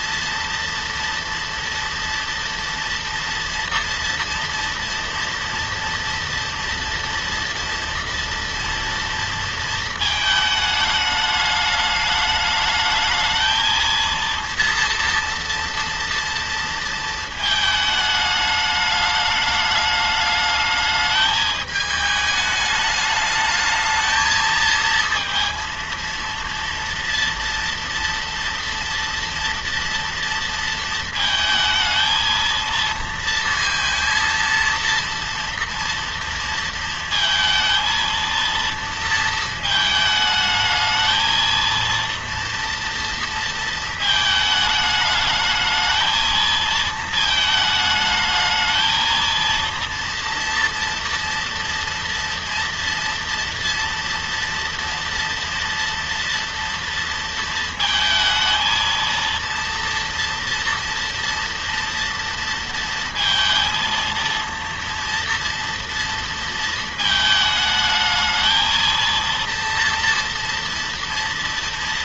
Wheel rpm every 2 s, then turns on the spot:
240, 240, 230, 230, 230, 220, 210, 230, 230, 210, 210, 210, 220, 230, 230, 230, 230, 230, 230, 230, 220, 230, 220, 230, 220, 230, 230, 230, 230, 230, 230, 230, 230, 230, 220, 230.
none